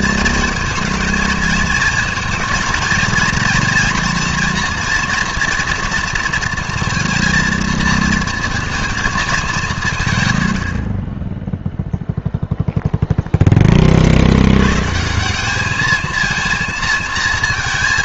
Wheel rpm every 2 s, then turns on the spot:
220, 220, 230, 230, 230, 90, 0, 110, 230.
none